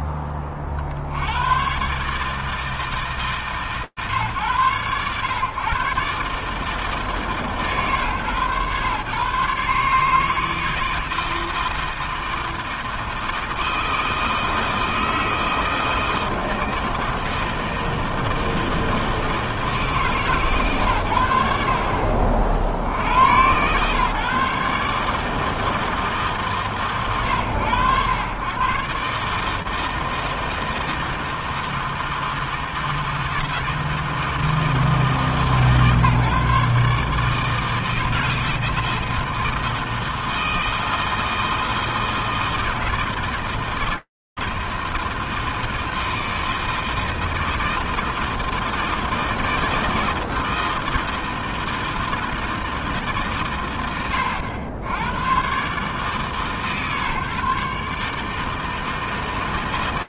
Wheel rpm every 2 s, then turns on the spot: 30, 150, 120, 150, 120, 160, 160, 160, 160, 160, 130, 70, 140, 150, 120, 160, 160, 160, 150, 160, 160, 160, 160, 160, 160, 160, 160, 80, 140, 150.
none